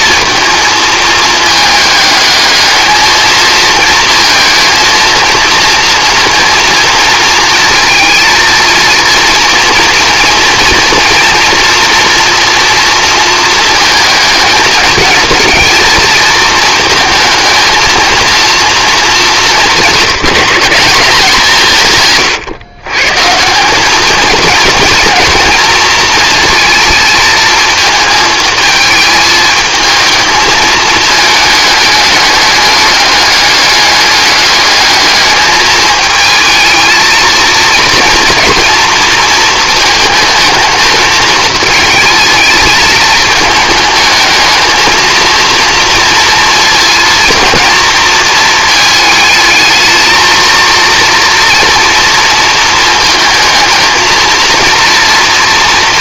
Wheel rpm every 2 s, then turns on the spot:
220, 220, 230, 230, 230, 230, 230, 210, 220, 220, 180, 130, 230, 230, 220, 220, 210, 210, 220, 230, 220, 220, 220, 230, 220, 230, 230, 230.
none